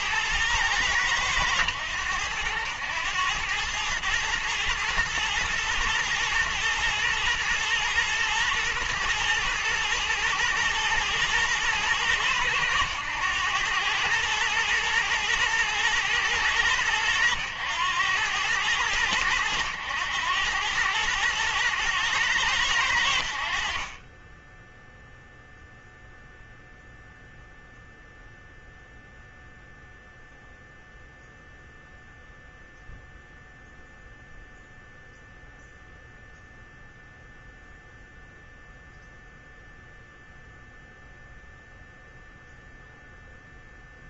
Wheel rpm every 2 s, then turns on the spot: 110, 100, 110, 110, 110, 110, 110, 110, 110, 100, 100, 90, 0, 0, 0, 0, 0, 0, 0, 0, 0, 0.
none